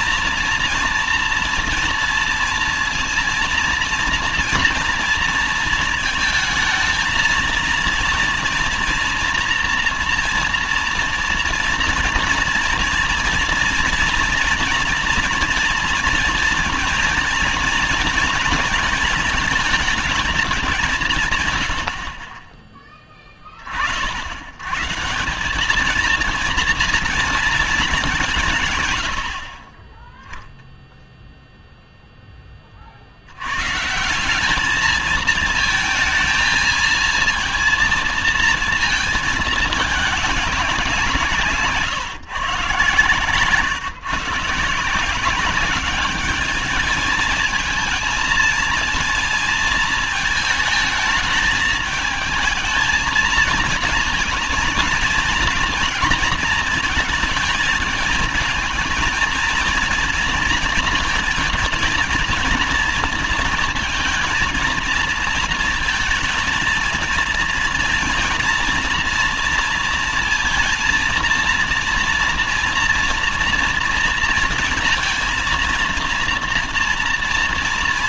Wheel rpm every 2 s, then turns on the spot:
230, 230, 230, 220, 240, 240, 230, 220, 230, 230, 190, 20, 120, 230, 130, 0, 30, 200, 220, 230, 190, 140, 160, 220, 230, 220, 220, 230, 230, 220, 220, 230, 230, 230, 230, 230, 240, 230, 230.
none